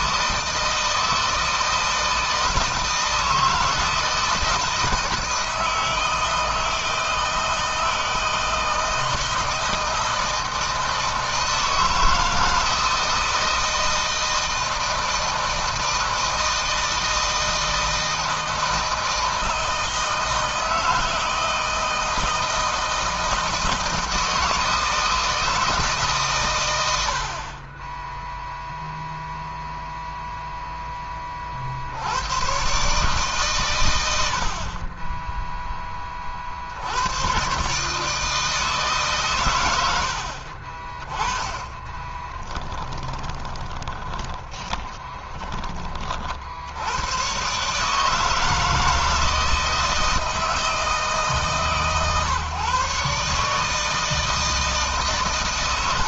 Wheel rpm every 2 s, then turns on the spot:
160, 160, 160, 160, 160, 160, 160, 160, 160, 160, 160, 160, 160, 50, 0, 30, 140, 20, 110, 130, 20, 20, 20, 110, 160, 150, 140, 130.
42-46